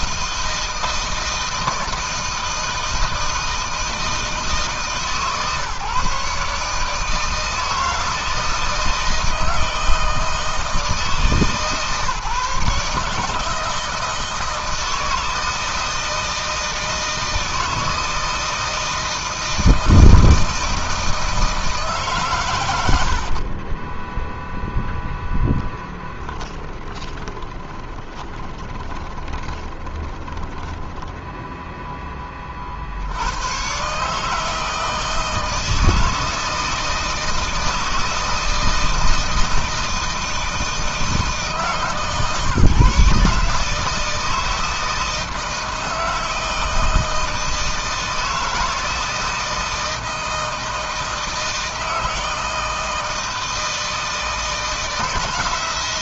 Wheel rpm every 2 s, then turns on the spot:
160, 160, 140, 160, 160, 160, 160, 160, 160, 160, 160, 70, 10, 20, 20, 0, 90, 160, 160, 160, 150, 140, 160, 160, 160, 160, 160, 160.
22-24 26-30